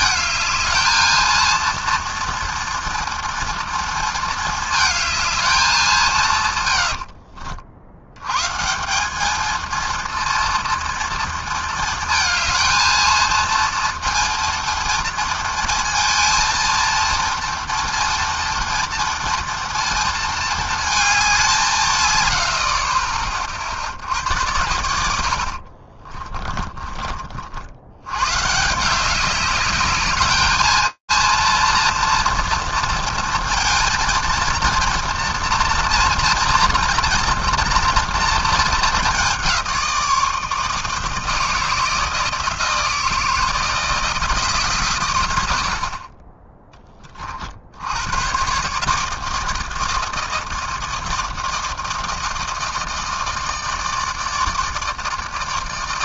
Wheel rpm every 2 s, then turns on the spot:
220, 230, 220, 140, 140, 230, 220, 230, 230, 240, 230, 70, 90, 20, 140, 220, 230, 230, 230, 210, 160, 160, 140, 10, 130, 160, 160, 160.
6-8 26-28